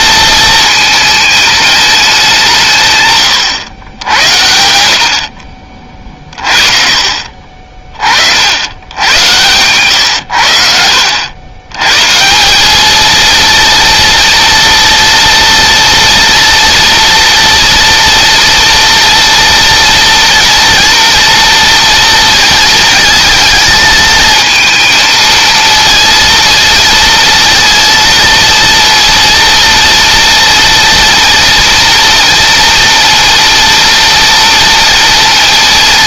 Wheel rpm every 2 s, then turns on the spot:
220, 140, 70, 40, 90, 70, 220, 230, 230, 230, 230, 220, 230, 230, 230, 230, 230, 230.
none